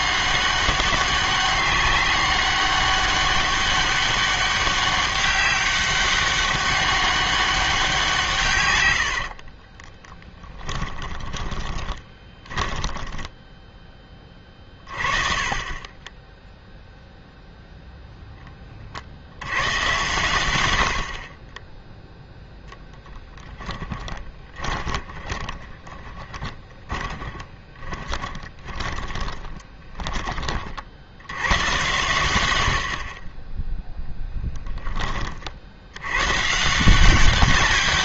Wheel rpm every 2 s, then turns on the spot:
190, 200, 200, 200, 130, 20, 10, 30, 0, 10, 100, 10, 20, 20, 20, 40, 90, 10, 160.
10-14 22-30